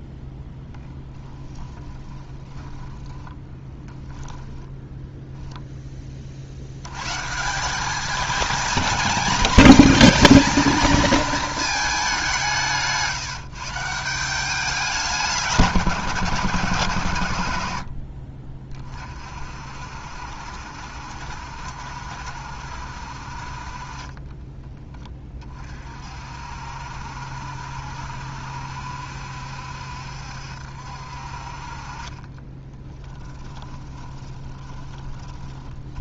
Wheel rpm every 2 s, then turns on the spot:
10, 20, 10, 90, 220, 220, 160, 190, 120, 40, 70, 60, 20, 60, 70, 60, 10, 20.
0-6 12-14 32-36